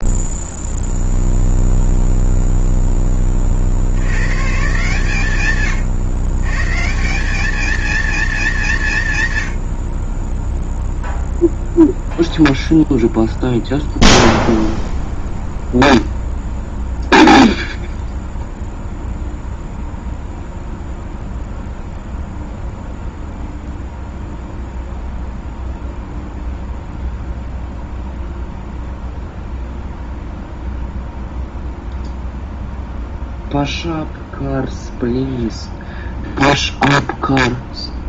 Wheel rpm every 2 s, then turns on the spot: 0, 0, 140, 130, 180, 10, 0, 0, 0, 0, 0, 0, 0, 0, 0, 0, 0, 0, 0.
none